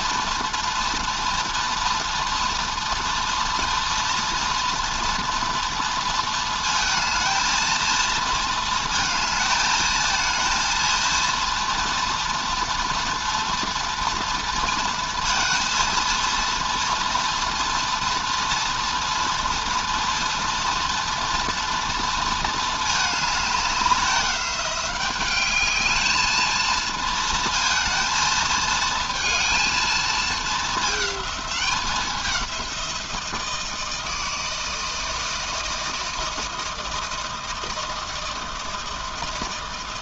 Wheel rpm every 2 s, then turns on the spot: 240, 230, 230, 220, 220, 230, 240, 230, 230, 230, 230, 220, 190, 230, 230, 220, 190, 160, 160, 160.
none